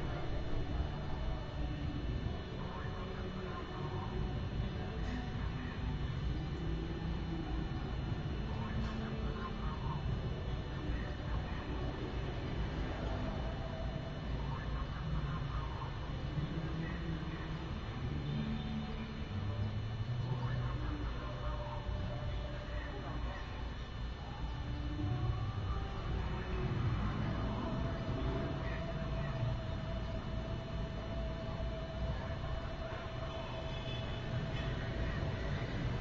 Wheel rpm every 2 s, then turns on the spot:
0, 0, 0, 0, 0, 0, 0, 0, 0, 0, 0, 0, 0, 0, 0, 0, 0, 0.
none